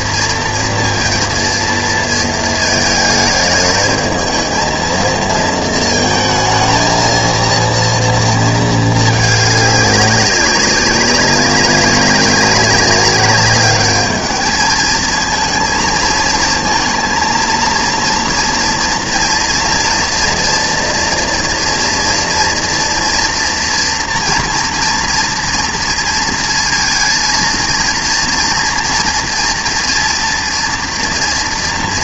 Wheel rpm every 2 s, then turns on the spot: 230, 220, 230, 230, 220, 190, 200, 220, 230, 230, 230, 230, 230, 230, 230, 230.
none